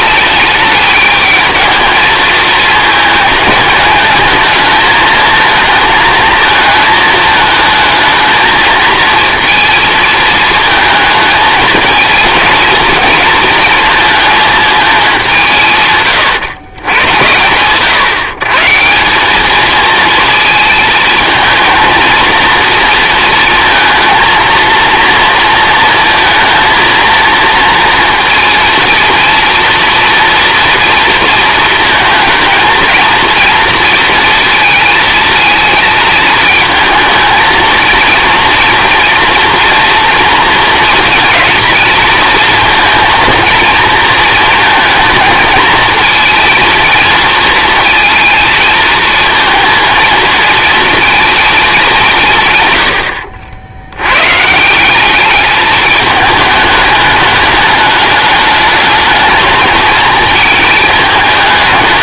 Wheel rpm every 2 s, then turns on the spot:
210, 220, 220, 220, 220, 220, 220, 220, 120, 150, 230, 230, 230, 230, 230, 230, 230, 220, 220, 230, 230, 230, 230, 230, 230, 220, 120, 160, 210, 210, 220.
none